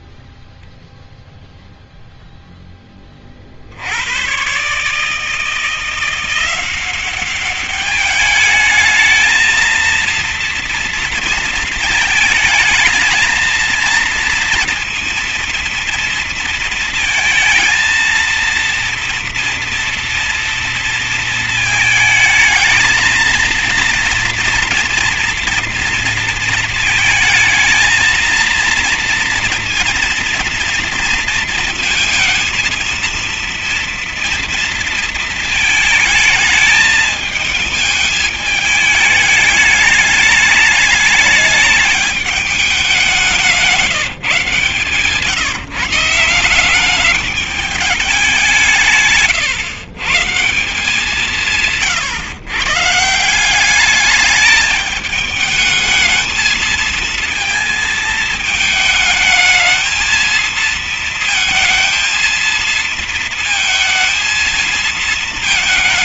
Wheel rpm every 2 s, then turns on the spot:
0, 0, 110, 180, 210, 230, 220, 230, 230, 230, 230, 220, 230, 230, 230, 240, 230, 240, 220, 210, 210, 210, 150, 180, 190, 150, 130, 210, 220, 220, 220, 230, 230.
none